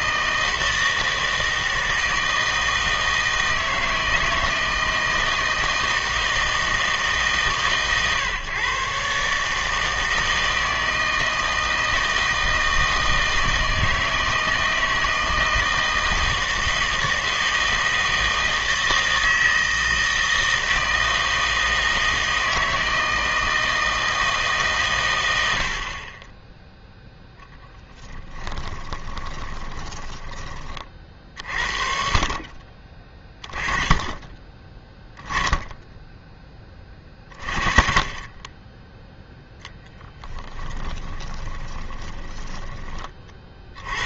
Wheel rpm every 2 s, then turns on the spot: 160, 160, 160, 160, 130, 160, 160, 160, 160, 160, 160, 160, 150, 10, 10, 40, 20, 20, 20, 10, 10, 20.
28-30 40-42